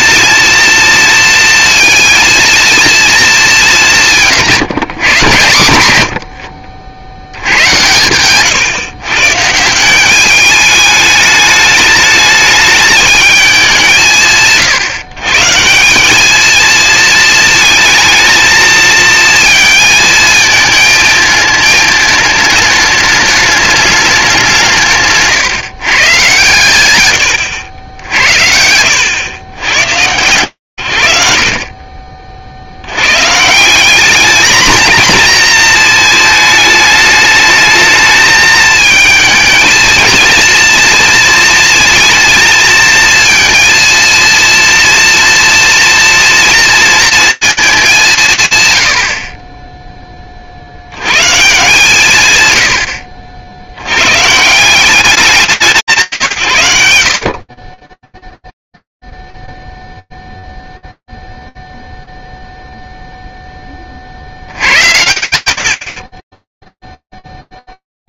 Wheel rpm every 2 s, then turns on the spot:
230, 230, 140, 60, 130, 210, 210, 150, 220, 220, 220, 210, 180, 120, 70, 130, 50, 210, 220, 220, 230, 230, 230, 230, 150, 50, 100, 170, 110, 0, 0, 0, 60, 20.
26-30